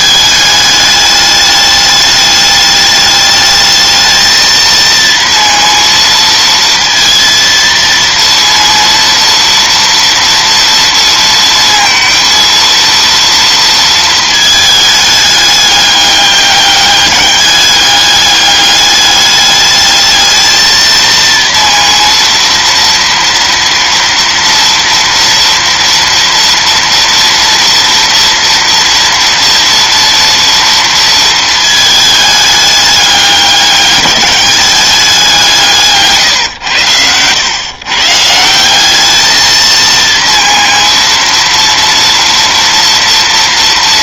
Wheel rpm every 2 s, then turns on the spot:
210, 210, 230, 230, 230, 230, 230, 210, 200, 210, 230, 230, 230, 230, 230, 230, 200, 200, 100, 200, 230, 230.
none